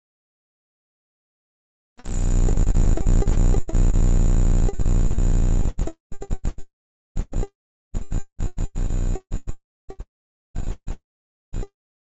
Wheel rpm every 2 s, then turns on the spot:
0, 0, 0, 0, 0, 0.
none